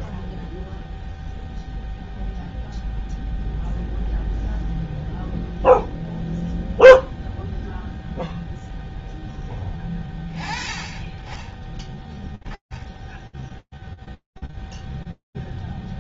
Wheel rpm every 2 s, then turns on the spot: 0, 0, 0, 0, 20, 10, 0, 0.
none